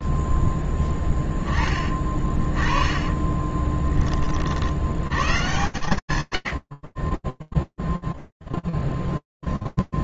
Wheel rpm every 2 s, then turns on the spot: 0, 20, 50, 90, 0.
6-8